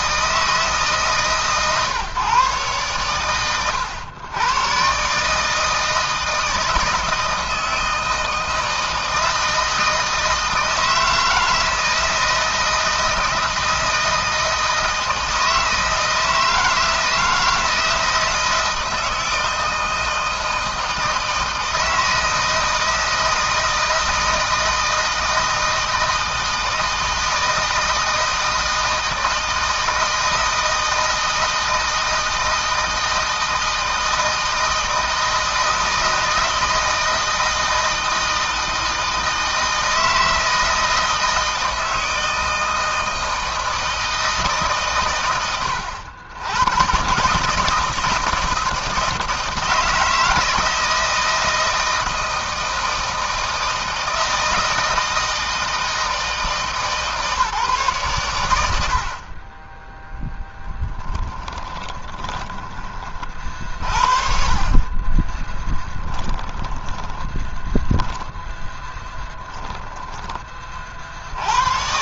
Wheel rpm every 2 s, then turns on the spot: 150, 110, 130, 160, 160, 160, 160, 160, 160, 160, 160, 160, 160, 160, 160, 160, 160, 160, 160, 160, 160, 160, 130, 110, 160, 160, 160, 160, 160, 70, 10, 30, 30, 20, 10, 50.
60-62 66-70